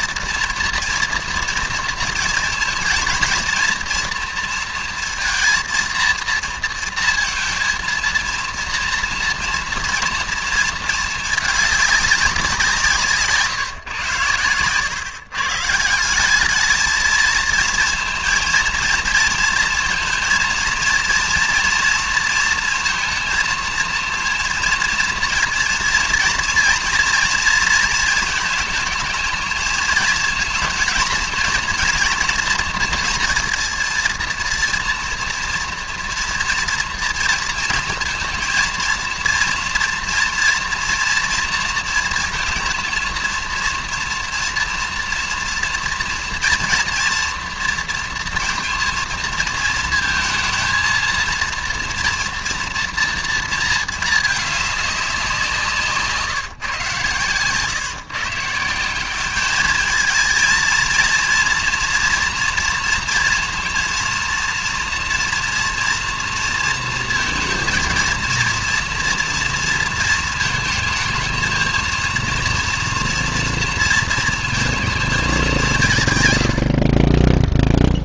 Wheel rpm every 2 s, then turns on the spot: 230, 230, 230, 230, 230, 220, 180, 110, 210, 230, 230, 230, 230, 230, 220, 230, 230, 230, 230, 230, 230, 230, 240, 230, 230, 230, 230, 210, 140, 160, 230, 230, 230, 230, 240, 230, 230, 230, 80.
none